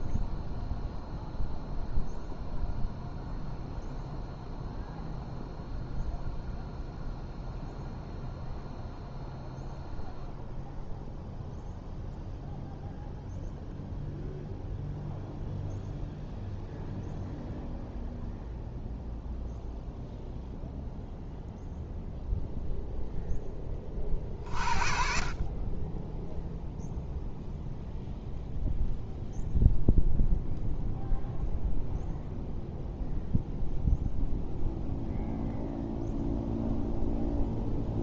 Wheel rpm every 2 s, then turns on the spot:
0, 0, 0, 0, 0, 0, 0, 0, 0, 0, 0, 0, 50, 0, 0, 0, 0, 0, 0.
none